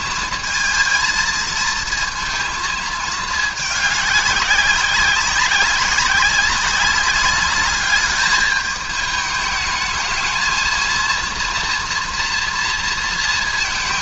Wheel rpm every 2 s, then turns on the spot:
230, 220, 200, 190, 210, 220, 230.
none